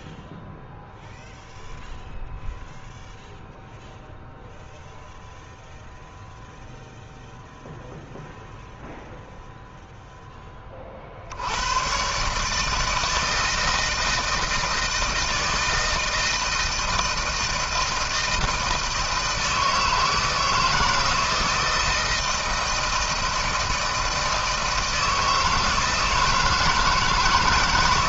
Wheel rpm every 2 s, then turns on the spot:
0, 0, 0, 0, 0, 20, 150, 160, 160, 160, 160, 160, 160, 160.
none